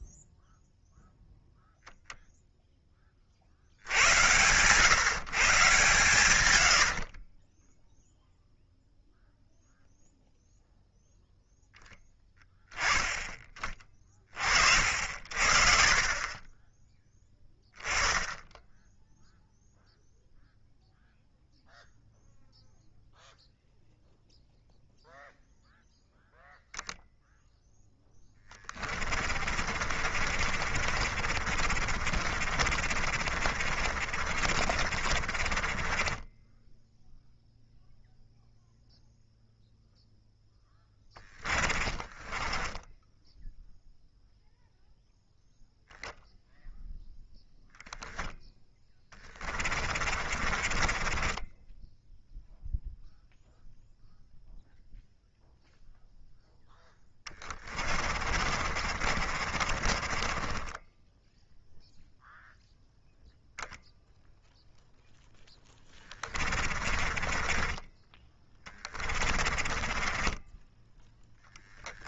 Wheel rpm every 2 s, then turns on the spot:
0, 10, 140, 90, 0, 0, 20, 50, 20, 10, 0, 0, 0, 0, 30, 50, 40, 40, 10, 0, 10, 10, 0, 0, 10, 30, 0, 0, 10, 50, 20, 0, 0, 30, 20, 10.
28-38 42-44 48-52 56-62 66-72